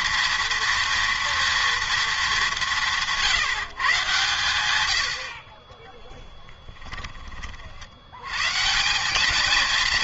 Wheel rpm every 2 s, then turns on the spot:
230, 180, 110, 10, 140.
none